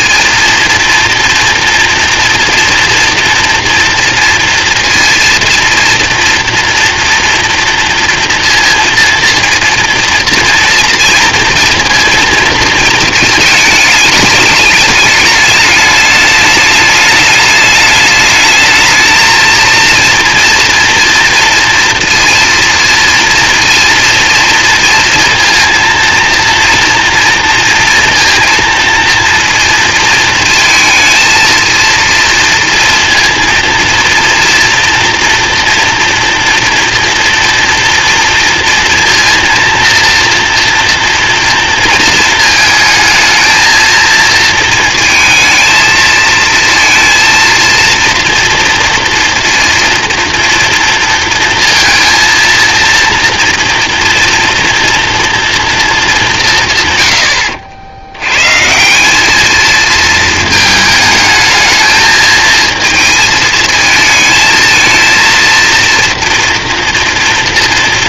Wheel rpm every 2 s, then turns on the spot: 230, 230, 230, 230, 230, 230, 230, 210, 210, 220, 230, 230, 230, 230, 230, 220, 230, 240, 240, 230, 230, 220, 230, 230, 230, 230, 230, 230, 150, 140, 220, 230, 220, 240.
none